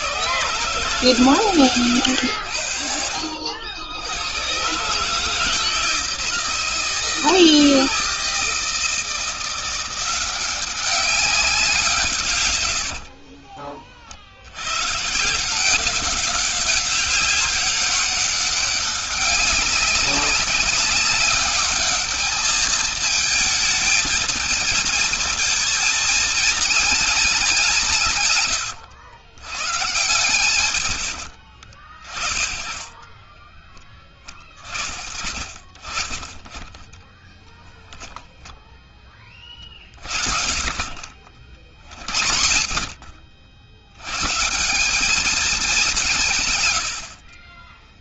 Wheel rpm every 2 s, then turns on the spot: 140, 80, 130, 160, 160, 190, 60, 120, 200, 200, 200, 220, 220, 230, 120, 90, 30, 50, 20, 20, 50, 60, 200, 90.
12-14 30-32 36-38 40-42